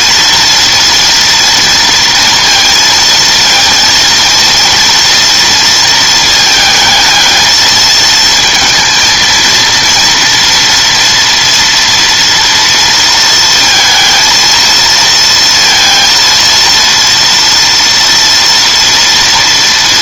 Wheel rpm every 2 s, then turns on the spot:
230, 230, 230, 220, 230, 230, 230, 230, 230, 230.
none